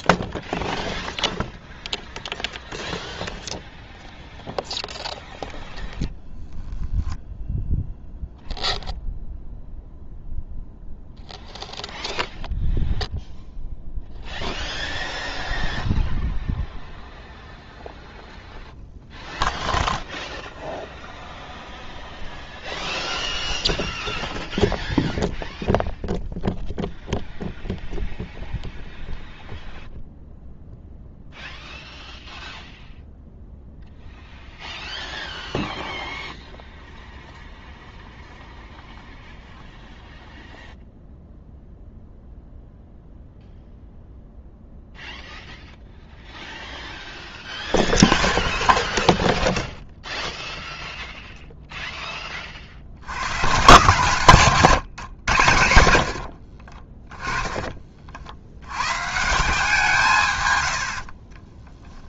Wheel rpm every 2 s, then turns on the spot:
0, 0, 0, 0, 0, 0, 0, 0, 0, 0, 0, 0, 0, 0, 0, 0, 0, 0, 0, 0, 0, 0, 0, 0, 0, 0, 40, 150, 50, 70, 100.
54-58